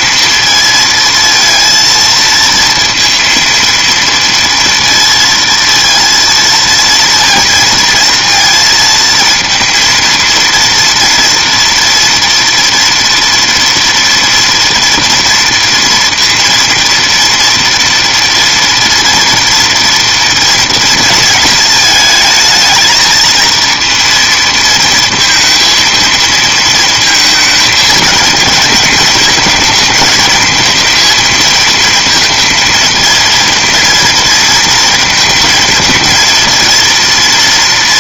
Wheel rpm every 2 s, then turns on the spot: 230, 230, 230, 230, 220, 230, 230, 240, 230, 230, 230, 220, 230, 230, 210, 220, 230, 220, 230.
none